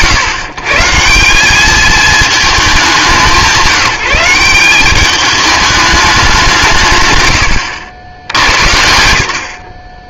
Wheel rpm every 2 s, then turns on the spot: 140, 200, 190, 130, 80.
none